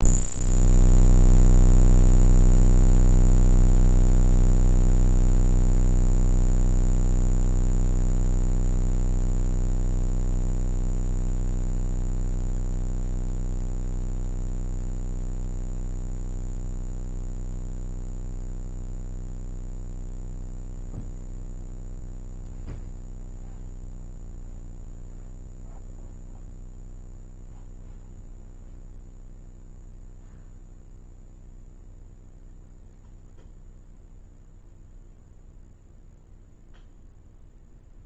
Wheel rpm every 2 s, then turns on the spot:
0, 0, 0, 0, 0, 0, 0, 0, 0, 0, 0, 0, 0, 0, 0, 0, 0, 0, 0.
none